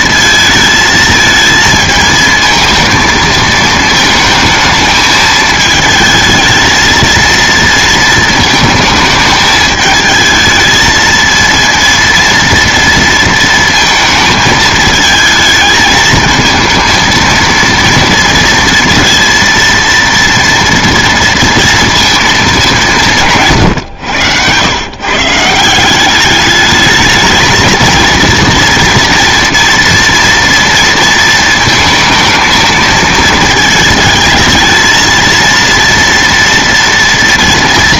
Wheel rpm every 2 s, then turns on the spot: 220, 220, 220, 230, 220, 220, 230, 220, 230, 230, 230, 170, 120, 220, 240, 230, 220, 220, 230.
none